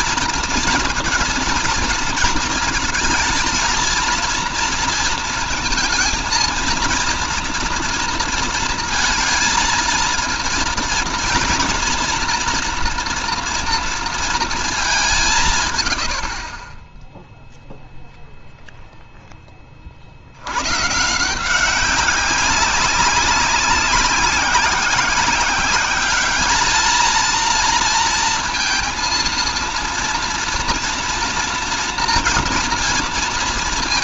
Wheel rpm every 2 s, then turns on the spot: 230, 230, 230, 230, 230, 230, 230, 210, 20, 0, 130, 190, 190, 220, 230, 230, 230.
none